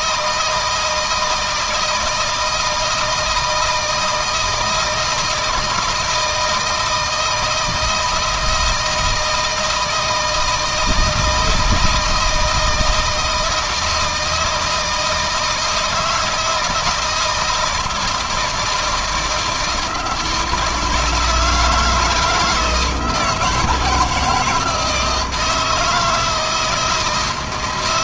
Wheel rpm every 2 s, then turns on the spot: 160, 160, 160, 160, 160, 160, 160, 160, 160, 170, 160, 160, 160, 160.
none